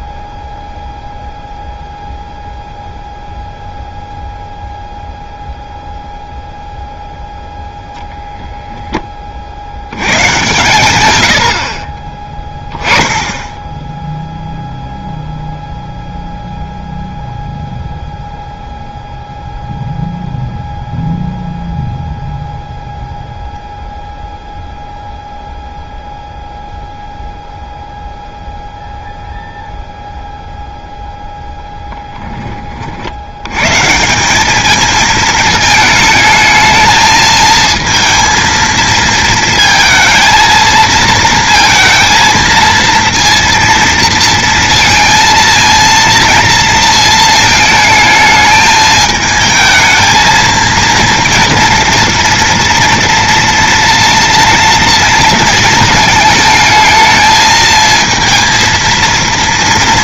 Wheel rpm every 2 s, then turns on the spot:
0, 0, 0, 0, 0, 110, 10, 0, 0, 0, 0, 0, 0, 0, 0, 0, 30, 200, 220, 230, 220, 230, 230, 230, 220, 230, 240, 230, 220, 230.
none